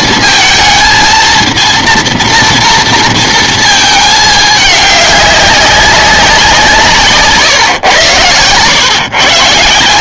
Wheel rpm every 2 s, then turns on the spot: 220, 230, 210, 160, 130.
none